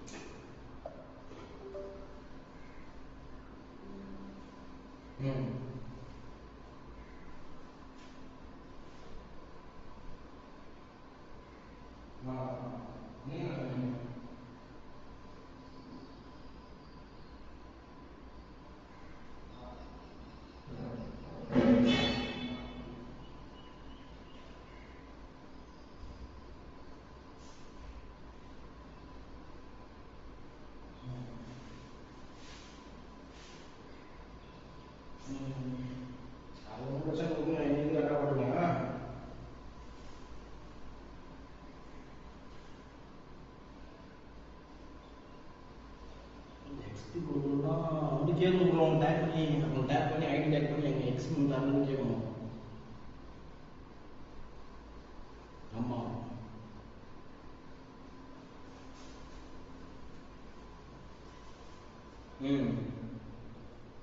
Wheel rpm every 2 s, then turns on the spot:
0, 0, 0, 0, 0, 0, 0, 0, 0, 0, 0, 0, 0, 0, 0, 0, 0, 0, 0, 0, 0, 0, 0, 0, 0, 0, 0, 0, 0, 0, 0, 0.
none